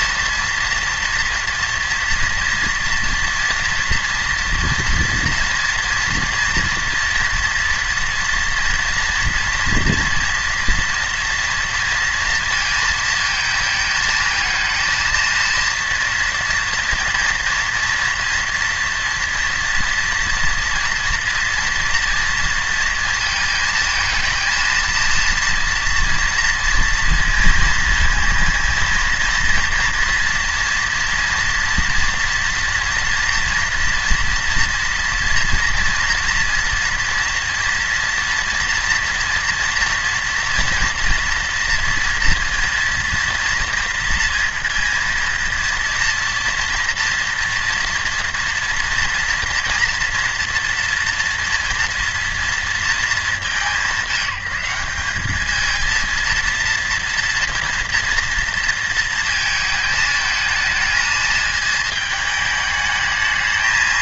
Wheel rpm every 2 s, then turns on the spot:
230, 230, 230, 230, 230, 230, 230, 230, 230, 230, 240, 230, 220, 230, 230, 230, 230, 230, 240, 240, 240, 230, 230, 230, 230, 240, 230, 190, 230, 230, 220, 210.
none